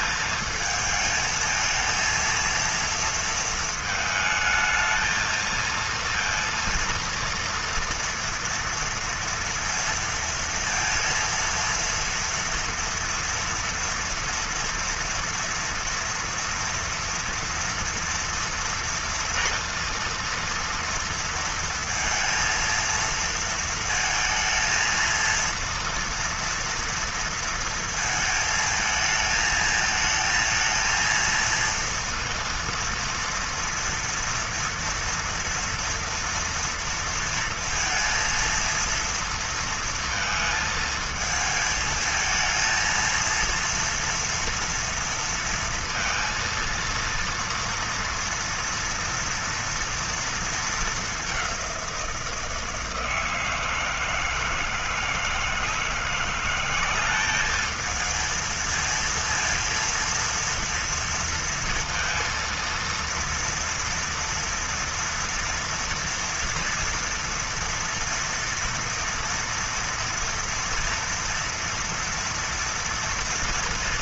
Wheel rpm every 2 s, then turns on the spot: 220, 230, 220, 230, 230, 230, 230, 240, 240, 240, 230, 230, 230, 230, 220, 220, 230, 230, 230, 230, 230, 220, 230, 230, 240, 230, 170, 160, 180, 230, 230, 230, 230, 230, 240, 230, 230.
none